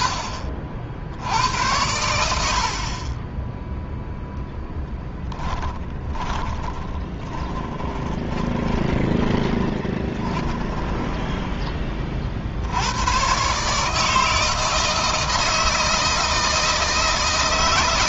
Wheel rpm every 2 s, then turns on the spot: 70, 40, 0, 20, 20, 10, 80, 160, 160.
6-12